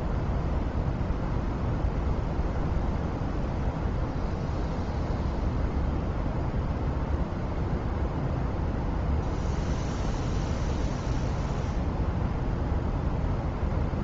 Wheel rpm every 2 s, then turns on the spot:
0, 0, 0, 0, 0, 0, 0.
none